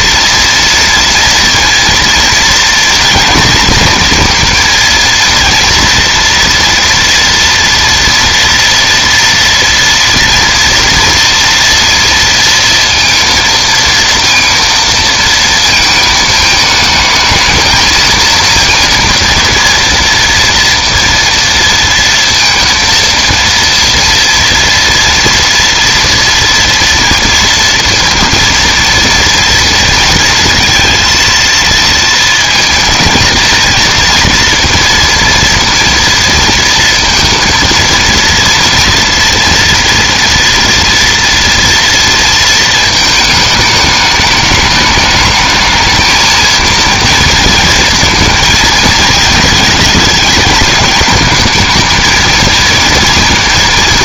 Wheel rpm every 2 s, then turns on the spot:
230, 230, 230, 230, 230, 230, 230, 230, 220, 230, 230, 230, 230, 230, 230, 230, 230, 230, 230, 230, 230, 220, 210, 230, 230, 210, 230.
none